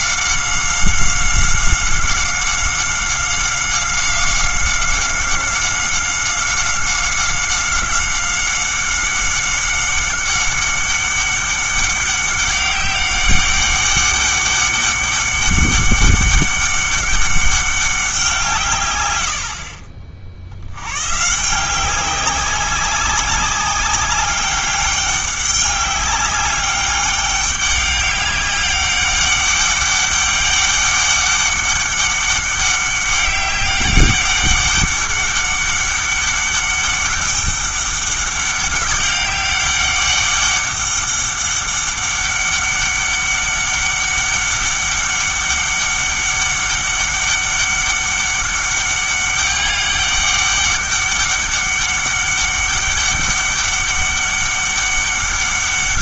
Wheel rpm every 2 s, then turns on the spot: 190, 190, 190, 190, 190, 200, 200, 200, 200, 150, 90, 190, 200, 200, 200, 200, 190, 200, 200, 190, 200, 200, 200, 200, 200, 200, 200, 200.
none